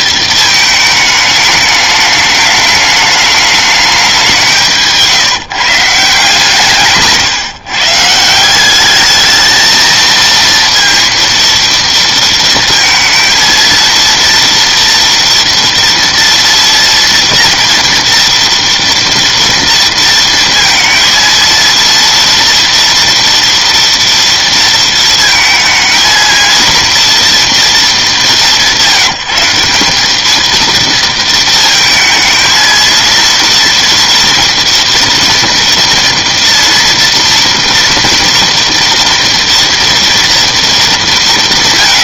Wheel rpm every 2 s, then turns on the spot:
220, 210, 180, 160, 180, 230, 230, 230, 230, 230, 230, 230, 230, 230, 170, 220, 220, 240, 230, 230, 230.
none